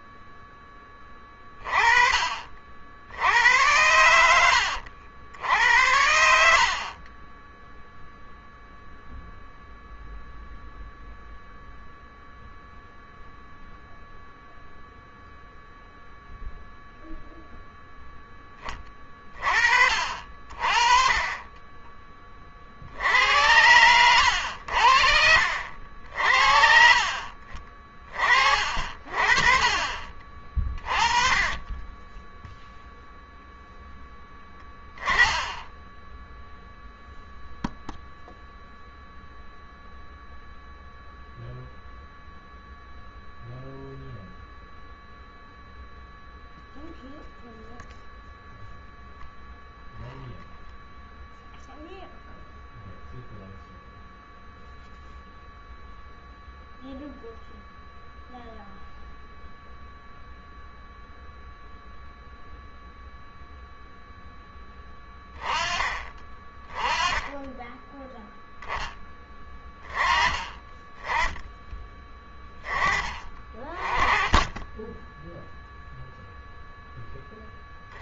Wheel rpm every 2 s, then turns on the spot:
10, 50, 90, 70, 0, 0, 0, 0, 0, 10, 50, 50, 70, 60, 30, 30, 10, 10, 0, 0, 0, 0, 0, 0, 0, 0, 0, 0, 0, 0, 0, 0, 10, 20, 10, 20, 20, 10, 0.
6-8 74-76